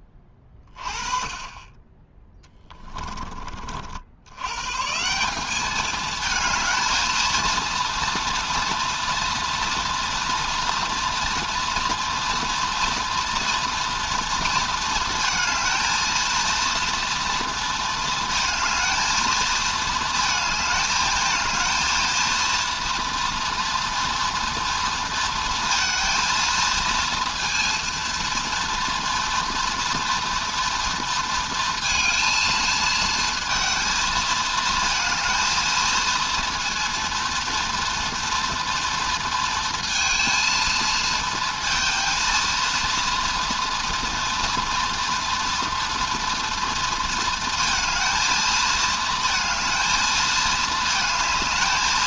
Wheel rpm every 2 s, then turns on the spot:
20, 10, 80, 220, 230, 230, 230, 230, 220, 220, 220, 230, 230, 230, 230, 230, 230, 230, 230, 230, 230, 230, 240, 230, 220, 220.
none